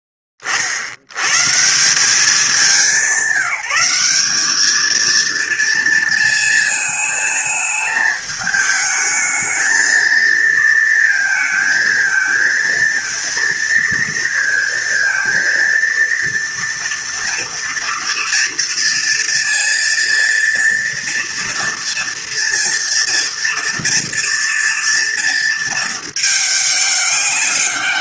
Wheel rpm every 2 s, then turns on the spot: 30, 190, 210, 220, 220, 230, 220, 230, 230, 230, 230, 230, 230, 210.
none